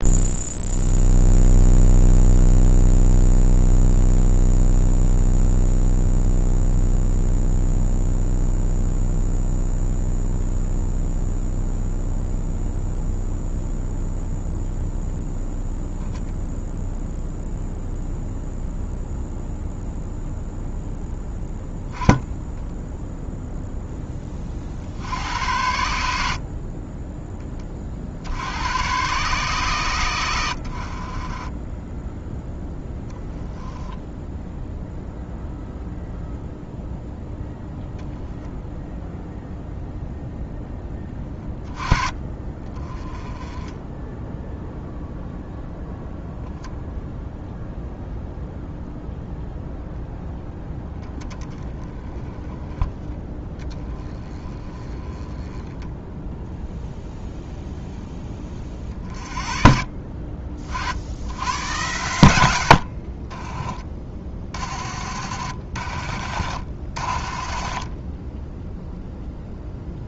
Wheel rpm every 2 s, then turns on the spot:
0, 0, 0, 0, 0, 0, 0, 0, 0, 0, 0, 0, 50, 40, 120, 60, 10, 0, 0, 0, 10, 30, 0, 0, 0, 10, 10, 20, 0, 50, 60, 50, 50, 50, 0.
66-68